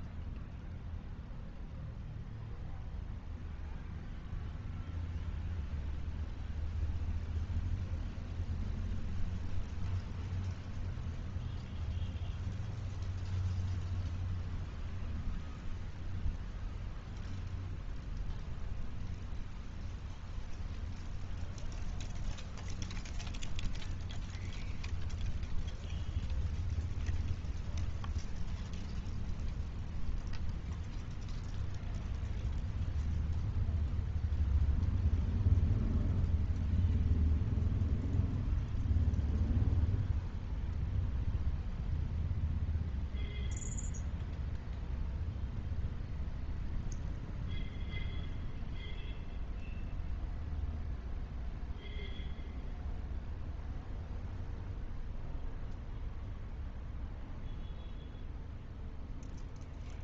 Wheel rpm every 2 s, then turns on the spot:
0, 0, 0, 0, 0, 0, 0, 0, 0, 0, 0, 0, 0, 0, 0, 0, 0, 0, 0, 0, 0, 0, 0, 0, 0, 0, 0, 0, 0, 0.
none